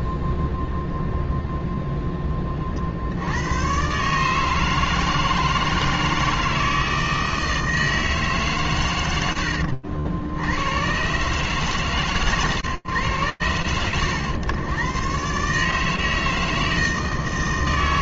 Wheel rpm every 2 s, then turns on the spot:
0, 120, 160, 160, 90, 140, 110, 160, 160.
none